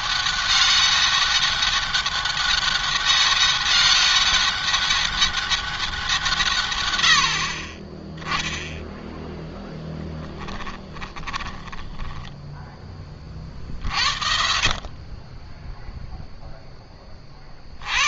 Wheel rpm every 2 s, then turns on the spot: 200, 200, 200, 120, 0, 20, 20, 30, 20.
10-12